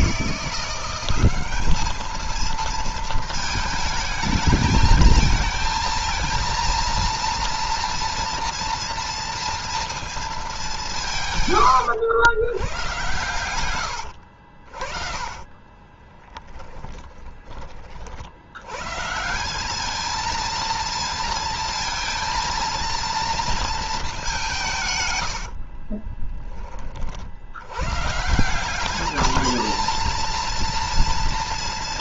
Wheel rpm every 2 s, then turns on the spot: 180, 220, 220, 230, 230, 190, 110, 50, 10, 110, 230, 230, 150, 20, 190, 230.
14-18 24-26